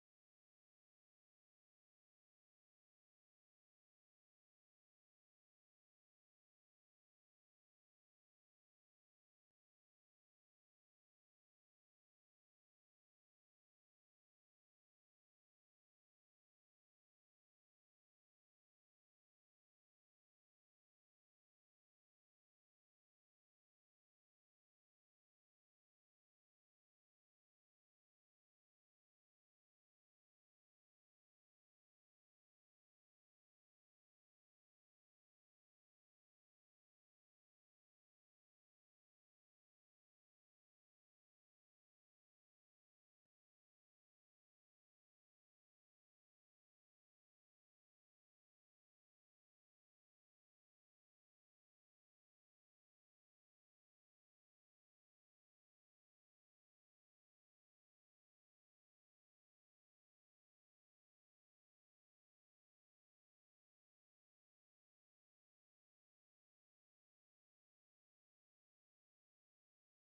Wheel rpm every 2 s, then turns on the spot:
0, 0, 0, 0, 0, 0, 0, 0, 0, 0, 0, 0, 0, 0, 0, 0, 0, 0, 0, 0, 0, 0, 0, 0, 0, 0, 0, 0, 0, 0, 0, 0, 0, 0, 0.
none